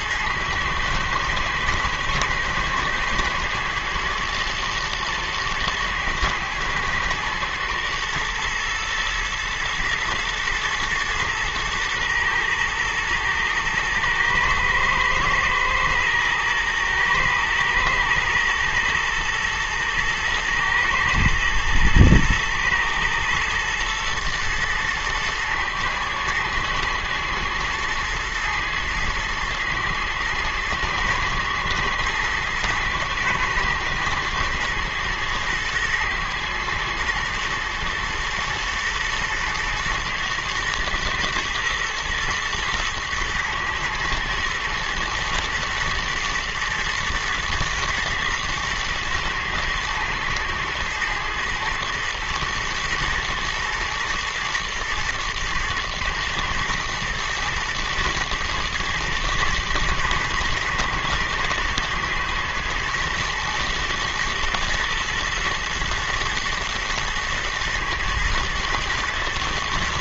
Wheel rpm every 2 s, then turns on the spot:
110, 120, 110, 110, 120, 120, 110, 110, 120, 110, 110, 110, 110, 120, 110, 110, 110, 110, 110, 120, 120, 110, 110, 120, 110, 120, 120, 120, 120, 120, 110, 120, 120, 110, 120.
none